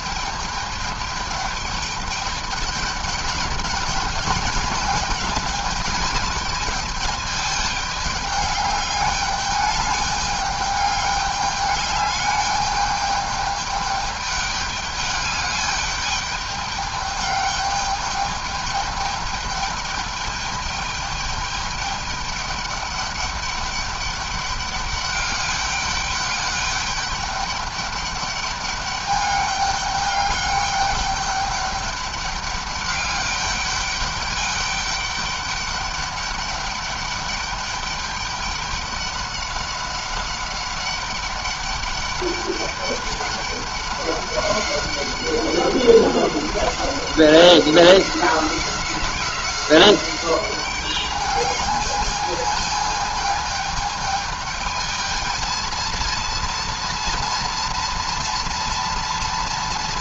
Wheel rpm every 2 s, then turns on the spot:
210, 200, 210, 210, 210, 210, 210, 210, 210, 210, 210, 210, 200, 200, 200, 200, 200, 200, 200, 200, 200, 200, 200, 190, 190, 200, 220, 220, 230, 240.
none